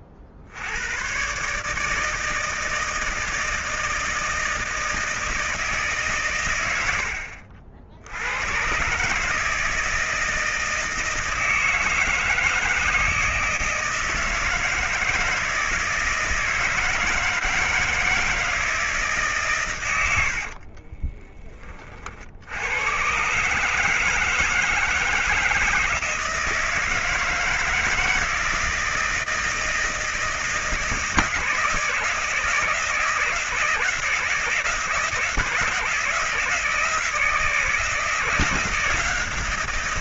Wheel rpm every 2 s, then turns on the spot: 70, 160, 160, 110, 110, 160, 160, 160, 160, 160, 50, 80, 160, 160, 160, 160, 160, 160, 160, 170.
20-22